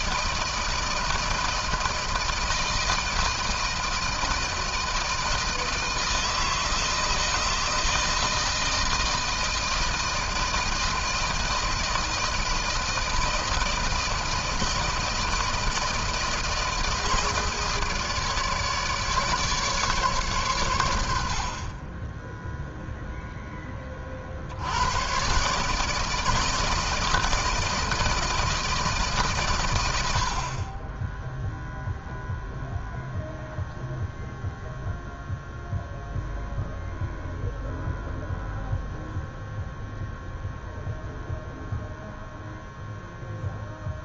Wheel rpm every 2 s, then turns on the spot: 160, 160, 160, 160, 160, 160, 160, 160, 160, 150, 120, 0, 70, 160, 160, 60, 0, 0, 0, 0, 0, 0.
none